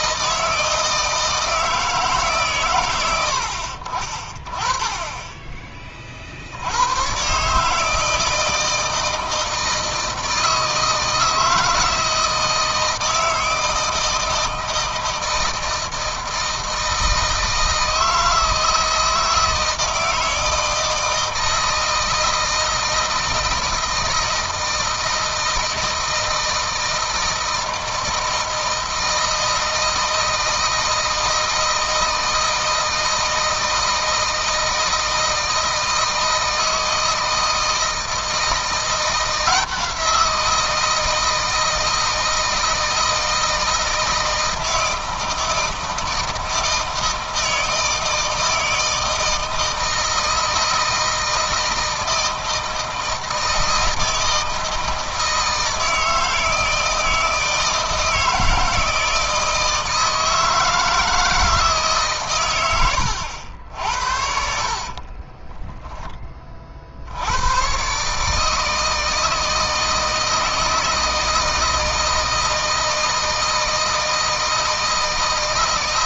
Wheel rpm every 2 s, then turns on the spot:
160, 120, 20, 70, 160, 160, 160, 160, 160, 160, 160, 160, 160, 160, 160, 160, 160, 160, 160, 170, 170, 160, 160, 160, 160, 160, 160, 160, 160, 160, 160, 110, 50, 40, 160, 160, 160, 160.
64-66